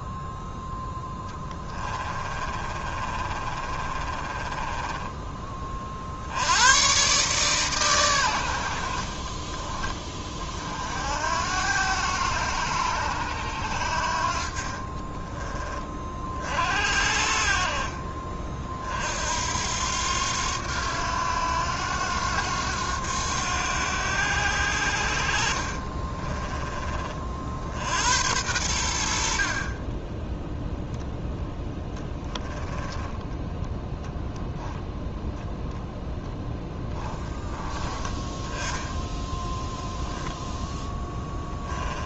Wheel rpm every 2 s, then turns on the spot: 0, 30, 10, 120, 60, 60, 90, 30, 50, 50, 90, 90, 70, 30, 80, 0, 10, 0, 10, 10, 0.
2-6 14-16 32-34